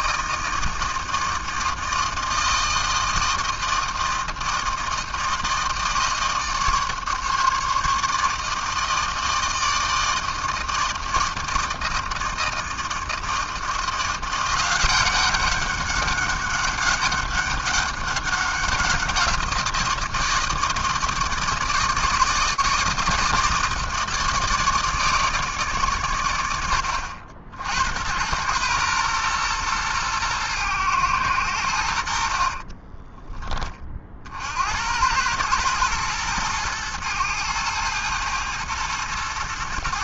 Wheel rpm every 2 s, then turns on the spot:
160, 160, 160, 150, 150, 160, 160, 180, 200, 190, 160, 160, 160, 80, 110, 110, 40, 70, 110, 110.
32-34